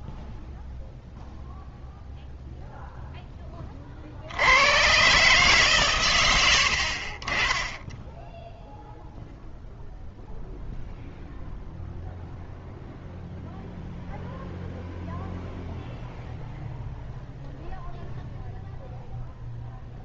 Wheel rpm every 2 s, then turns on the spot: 0, 40, 120, 10, 0, 0, 0, 0, 0, 0.
none